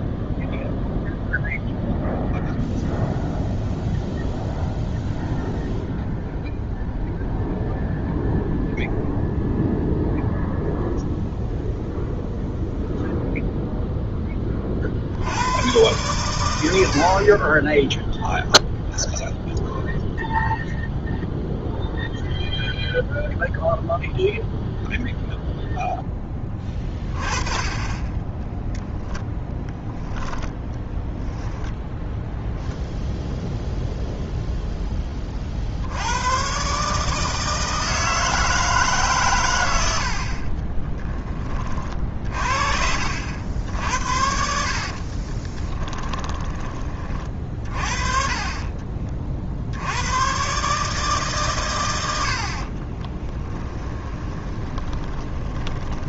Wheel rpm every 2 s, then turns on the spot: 0, 0, 0, 0, 0, 0, 0, 40, 90, 0, 0, 0, 0, 20, 10, 10, 0, 10, 140, 160, 20, 50, 60, 20, 20, 140, 40, 20.
28-32 40-42 44-48 52-56